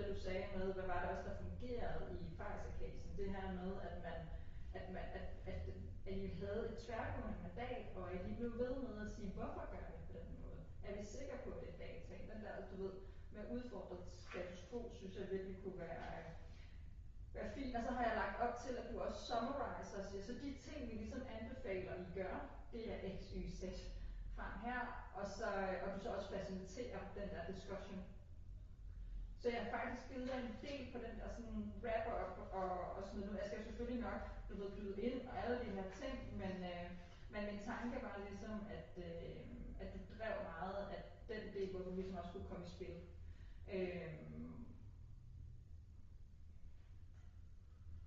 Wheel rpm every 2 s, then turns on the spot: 0, 0, 0, 0, 0, 0, 0, 0, 0, 0, 0, 0, 0, 0, 0, 0, 0, 0, 0, 0, 0, 0, 0, 0.
none